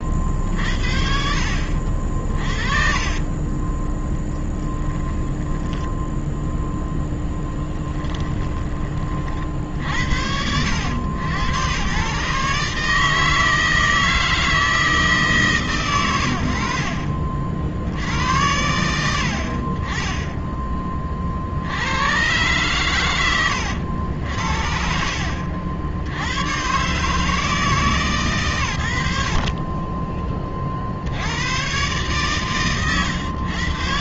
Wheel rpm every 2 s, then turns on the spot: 50, 50, 20, 0, 20, 70, 130, 160, 100, 70, 20, 110, 80, 90, 120, 30, 140.
2-6 8-10 30-32